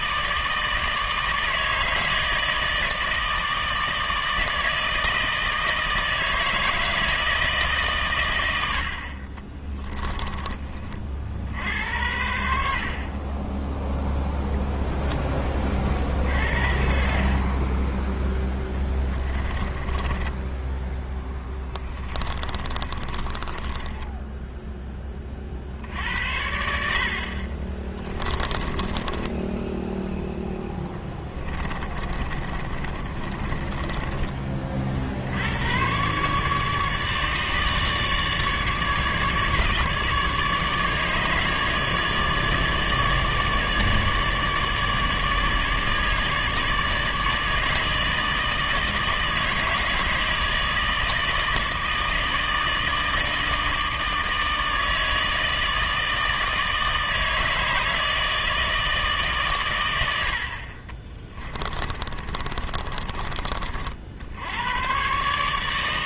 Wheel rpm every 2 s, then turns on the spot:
160, 160, 160, 160, 80, 30, 60, 0, 60, 10, 10, 30, 10, 60, 20, 10, 40, 40, 150, 150, 150, 150, 150, 150, 160, 160, 160, 160, 160, 160, 50, 40, 100.
18-20 22-24 28-34 60-64